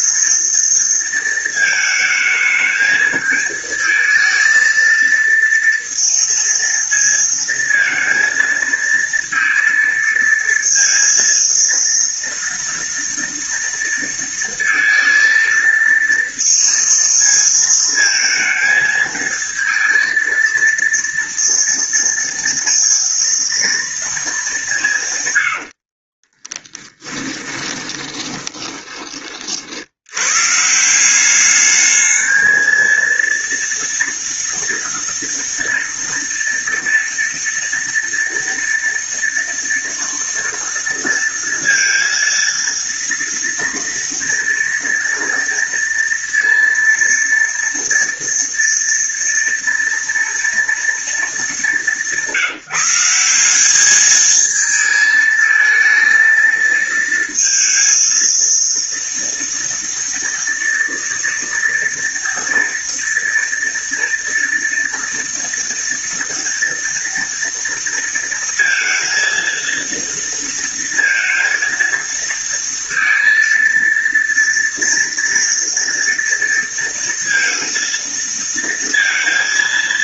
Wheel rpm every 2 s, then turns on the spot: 230, 220, 230, 230, 230, 230, 230, 230, 230, 230, 230, 230, 140, 10, 20, 180, 230, 230, 230, 230, 230, 230, 230, 230, 230, 230, 180, 220, 220, 230, 230, 230, 230, 230, 230, 230, 230, 230, 230, 230.
26-28